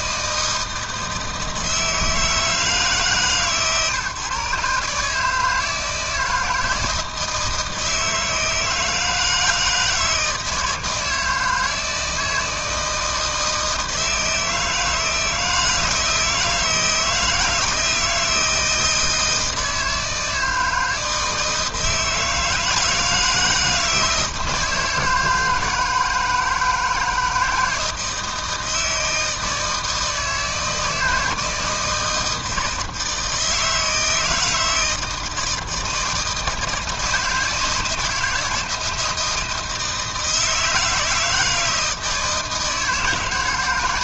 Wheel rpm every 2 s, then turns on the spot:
160, 150, 150, 160, 160, 160, 160, 160, 160, 160, 160, 160, 160, 160, 160, 160, 160, 160, 160, 170, 160, 150.
none